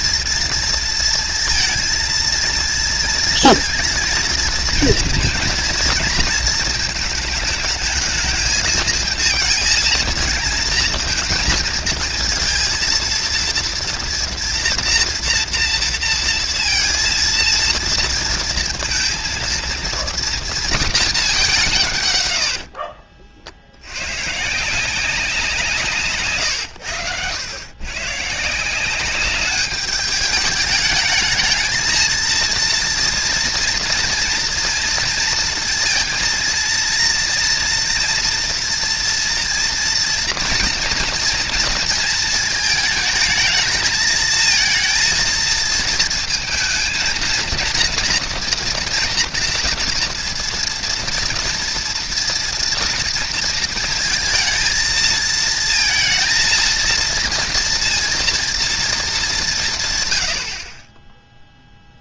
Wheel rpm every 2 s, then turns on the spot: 230, 230, 230, 220, 220, 220, 230, 240, 230, 230, 220, 50, 170, 110, 170, 210, 230, 230, 230, 230, 230, 220, 220, 220, 230, 230, 230, 220, 230, 230, 30.
22-24